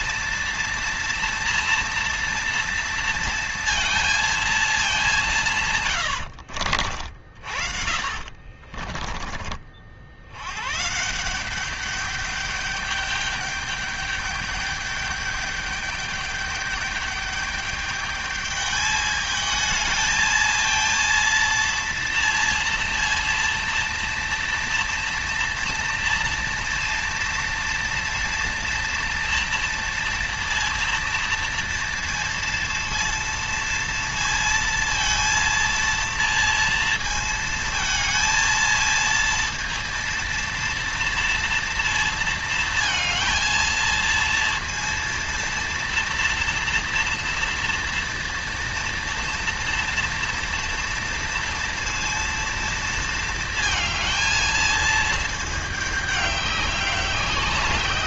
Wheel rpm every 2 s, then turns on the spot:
240, 230, 220, 80, 40, 120, 200, 210, 200, 210, 220, 230, 230, 230, 230, 230, 230, 230, 230, 230, 230, 230, 230, 230, 230, 230, 230, 220, 190.
6-10